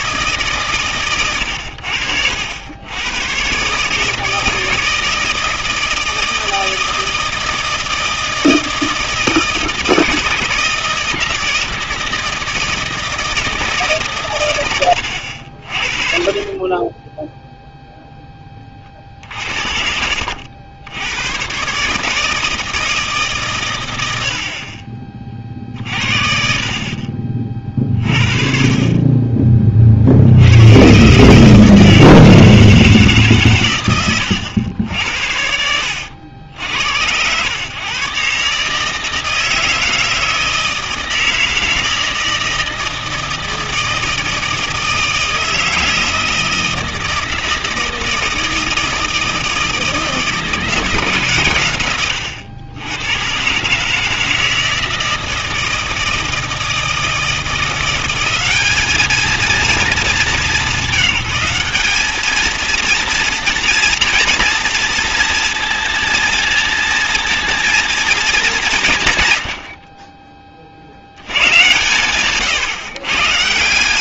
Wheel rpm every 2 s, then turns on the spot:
140, 90, 160, 160, 160, 160, 160, 110, 20, 30, 80, 160, 40, 50, 30, 110, 160, 80, 80, 150, 160, 160, 160, 160, 160, 160, 100, 160, 160, 210, 190, 230, 230, 230, 180, 50, 140.
18-20